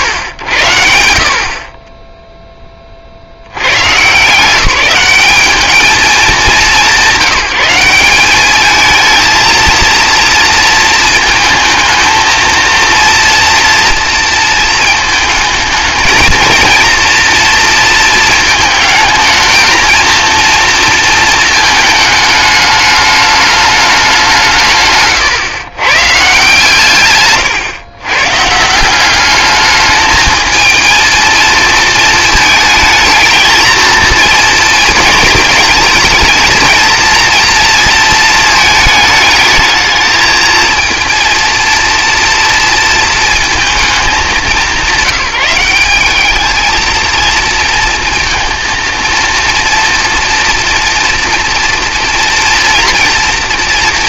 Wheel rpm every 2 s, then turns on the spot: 80, 20, 190, 180, 210, 230, 230, 220, 230, 220, 230, 210, 160, 140, 160, 220, 220, 230, 230, 220, 230, 230, 180, 220, 230, 240, 240.
none